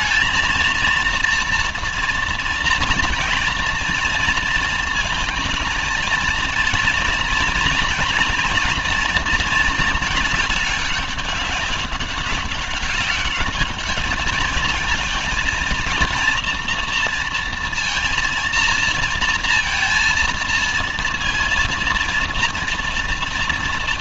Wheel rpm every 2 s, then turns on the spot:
230, 230, 230, 230, 230, 210, 200, 220, 230, 230, 230, 230.
none